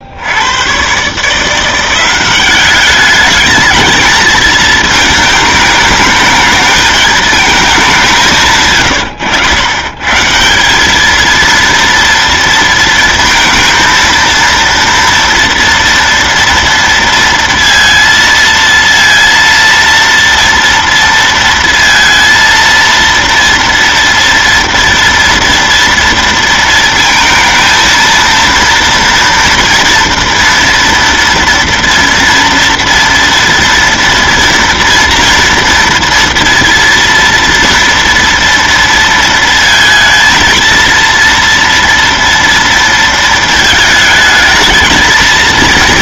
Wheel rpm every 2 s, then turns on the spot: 100, 200, 220, 220, 140, 180, 230, 230, 230, 230, 230, 230, 240, 230, 230, 230, 230, 230, 230, 230, 230, 230, 220.
8-10